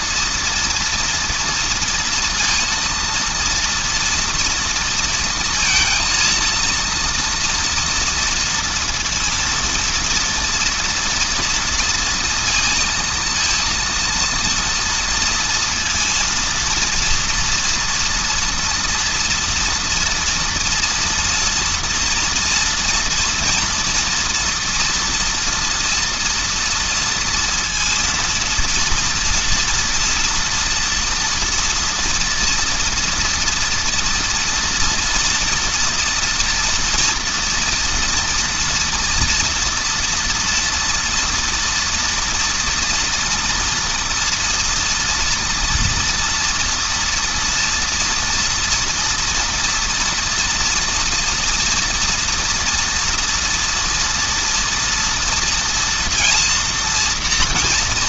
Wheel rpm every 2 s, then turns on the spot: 230, 230, 230, 230, 230, 230, 230, 230, 240, 230, 230, 240, 230, 230, 240, 240, 230, 230, 230, 230, 230, 230, 230, 230, 230, 230, 230, 240, 230.
none